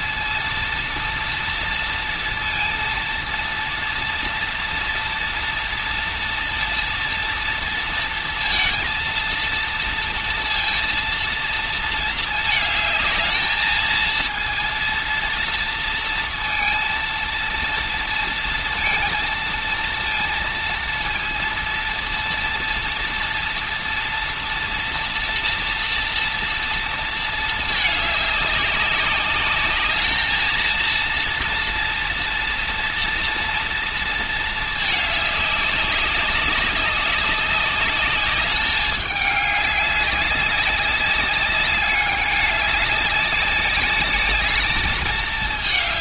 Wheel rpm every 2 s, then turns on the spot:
230, 230, 230, 230, 230, 230, 220, 230, 230, 230, 230, 230, 240, 230, 200, 230, 230, 220, 200, 210, 200, 200, 210.
none